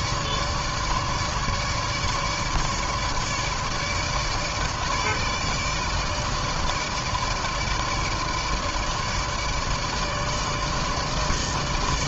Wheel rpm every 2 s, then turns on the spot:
150, 150, 150, 160, 150, 150.
none